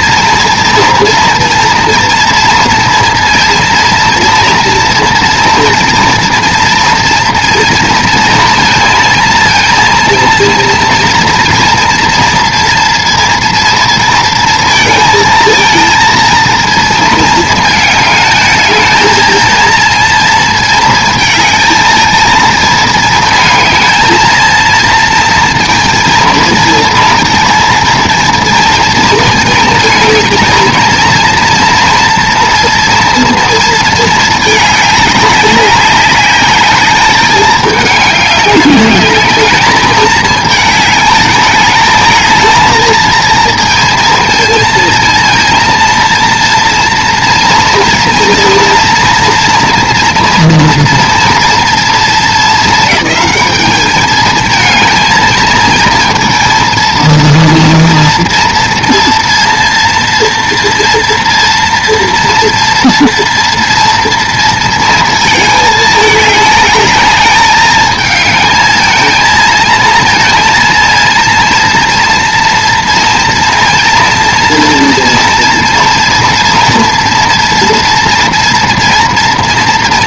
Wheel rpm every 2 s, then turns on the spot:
230, 230, 240, 230, 230, 230, 230, 230, 220, 220, 220, 220, 230, 230, 230, 230, 230, 200, 210, 200, 210, 230, 230, 240, 230, 230, 210, 220, 230, 230, 230, 230, 220, 210, 220, 230, 230, 230, 230, 230.
none